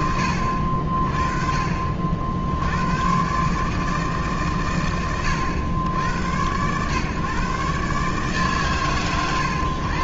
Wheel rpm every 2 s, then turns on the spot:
30, 130, 80, 130, 120.
none